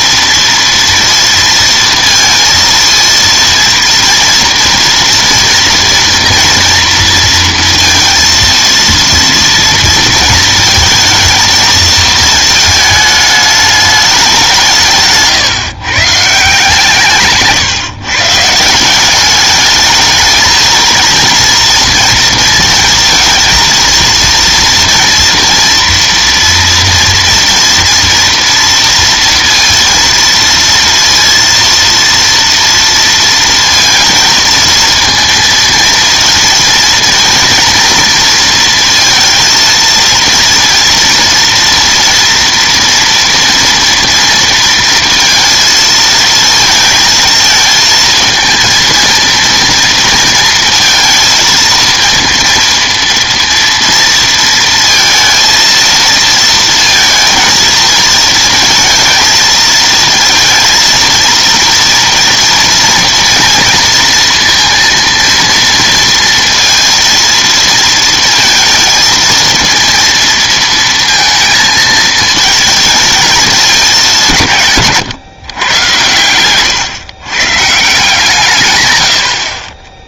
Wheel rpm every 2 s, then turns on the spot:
230, 230, 230, 240, 230, 220, 220, 180, 160, 160, 230, 230, 230, 230, 230, 230, 230, 230, 230, 230, 230, 230, 230, 230, 230, 230, 230, 230, 230, 230, 230, 230, 230, 230, 230, 230, 220, 140, 110, 130.
none